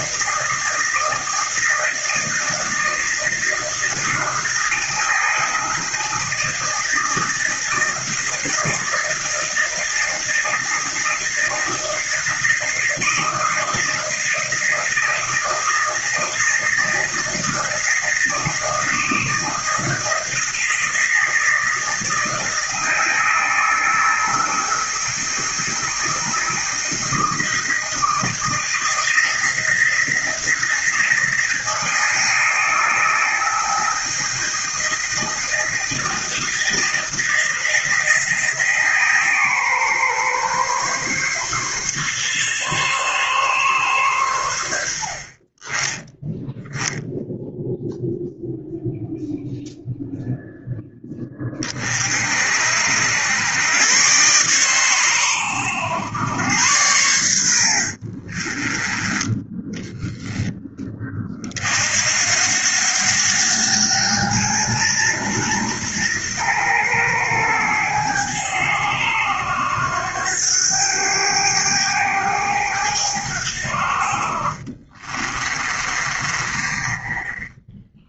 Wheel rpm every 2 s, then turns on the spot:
160, 160, 160, 160, 160, 160, 160, 160, 160, 160, 160, 160, 160, 160, 160, 170, 160, 160, 160, 150, 140, 140, 50, 0, 0, 20, 80, 100, 90, 10, 30, 100, 120, 110, 90, 100, 90, 30, 20.
74-78